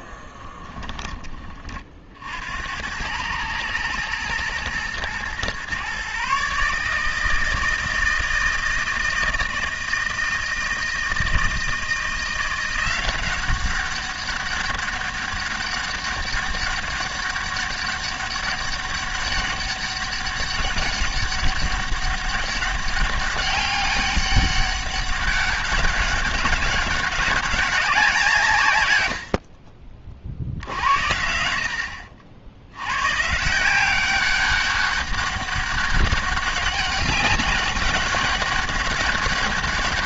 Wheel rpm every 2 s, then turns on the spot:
20, 80, 120, 150, 160, 160, 180, 200, 200, 200, 200, 200, 190, 200, 120, 70, 100, 200, 200, 200.
0-2